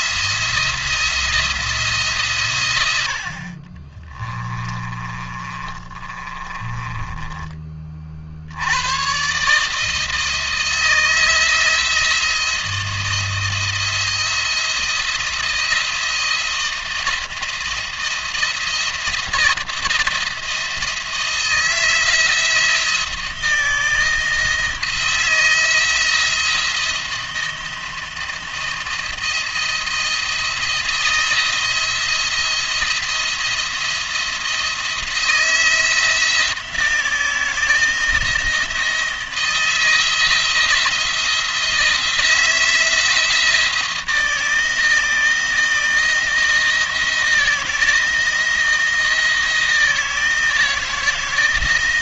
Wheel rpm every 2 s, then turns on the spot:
170, 100, 30, 30, 100, 160, 170, 170, 170, 170, 170, 170, 160, 170, 170, 170, 170, 170, 160, 160, 170, 170, 160, 170, 170, 160.
4-8